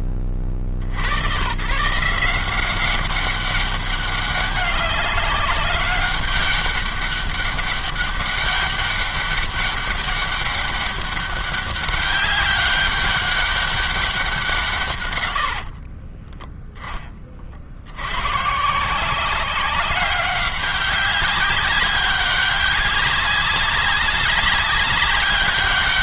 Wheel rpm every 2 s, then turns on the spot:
60, 180, 200, 200, 200, 200, 200, 140, 20, 170, 190, 200, 200.
none